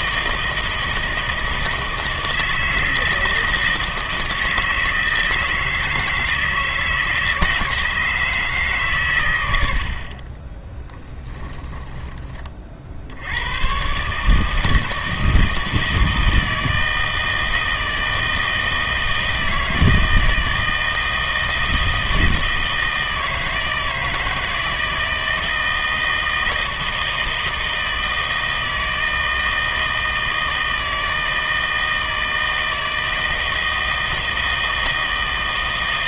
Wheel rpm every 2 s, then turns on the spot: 160, 160, 160, 160, 140, 20, 50, 160, 160, 160, 160, 160, 160, 160, 160, 160, 160, 160.
10-12